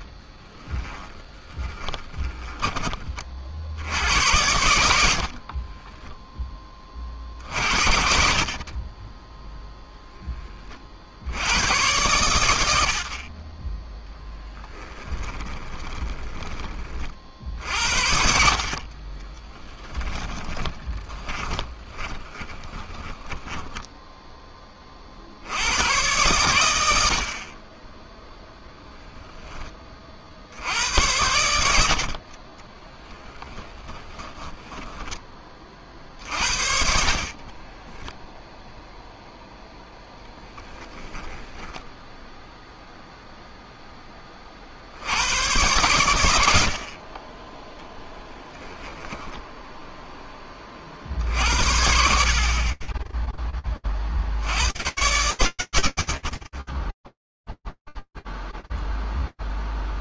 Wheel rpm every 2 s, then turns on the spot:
10, 30, 50, 20, 30, 30, 60, 10, 20, 50, 20, 10, 10, 100, 0, 70, 20, 10, 60, 0, 10, 0, 20, 100, 10, 20, 40, 90, 10, 0.
0-2 14-16 20-24 32-34 36-38 40-42 48-50